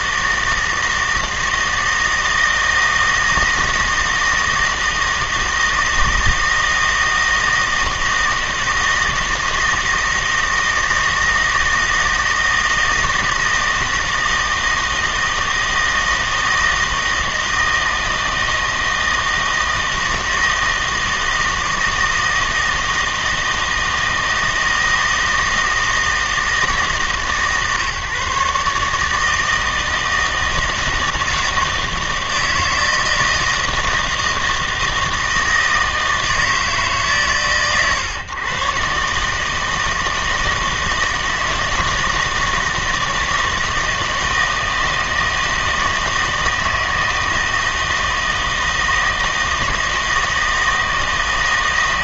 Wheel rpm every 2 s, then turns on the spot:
160, 160, 160, 160, 160, 160, 160, 160, 160, 160, 160, 160, 160, 160, 140, 160, 160, 160, 160, 120, 160, 160, 160, 160, 160, 160.
none